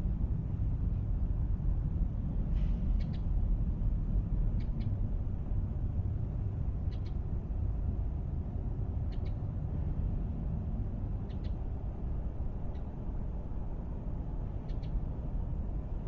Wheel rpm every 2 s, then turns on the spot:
0, 0, 0, 0, 0, 0, 0, 0.
none